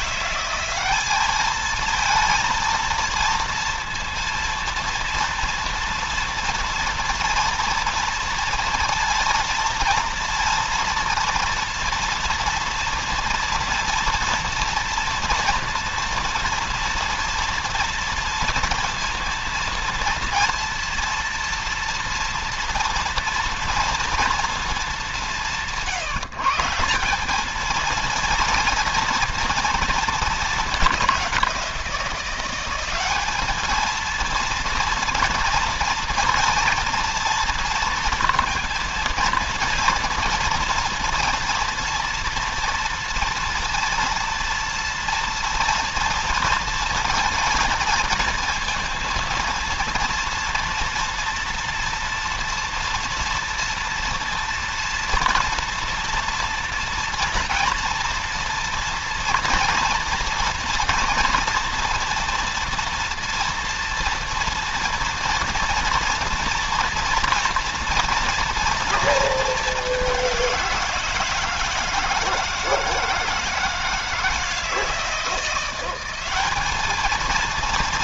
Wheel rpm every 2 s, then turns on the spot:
200, 230, 230, 230, 230, 230, 240, 230, 230, 230, 230, 240, 210, 170, 230, 210, 190, 230, 230, 230, 230, 230, 230, 230, 230, 230, 230, 230, 230, 230, 240, 230, 230, 230, 230, 170, 160, 170, 220.
none